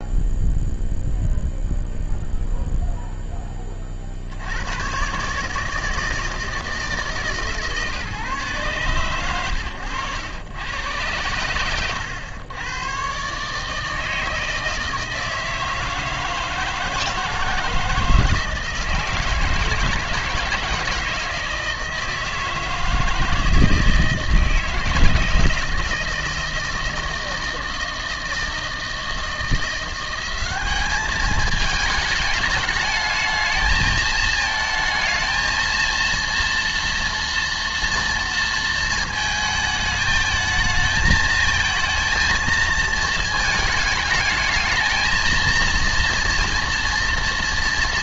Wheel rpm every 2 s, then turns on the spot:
0, 0, 80, 160, 130, 110, 100, 160, 160, 160, 160, 160, 160, 160, 160, 200, 220, 220, 230, 230, 220, 220, 210, 230.
none